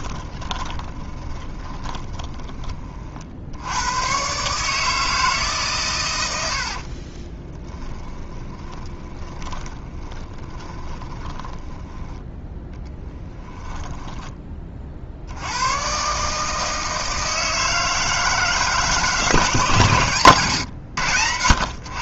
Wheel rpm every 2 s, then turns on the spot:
20, 40, 150, 70, 10, 20, 10, 30, 160, 160, 110.
0-2 6-12 20-22